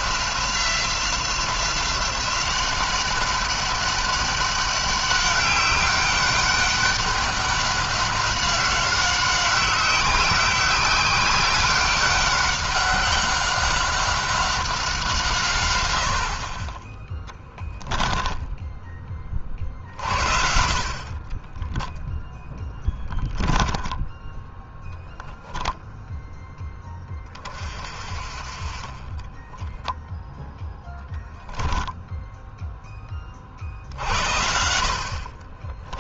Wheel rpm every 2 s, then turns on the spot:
180, 190, 200, 200, 190, 190, 190, 180, 30, 20, 50, 10, 10, 20, 30, 10, 10, 60.
22-24 28-30